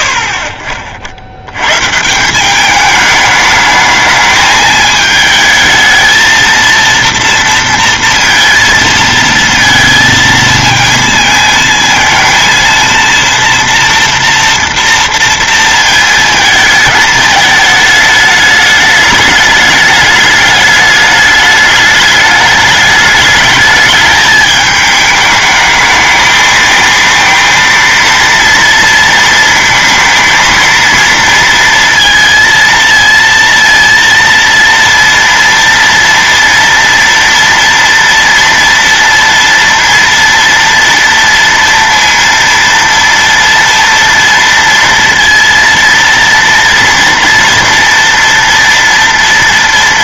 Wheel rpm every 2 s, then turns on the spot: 50, 200, 220, 230, 230, 230, 230, 230, 220, 210, 210, 210, 210, 220, 230, 230, 230, 230, 230, 230, 230, 230, 230, 230, 230.
none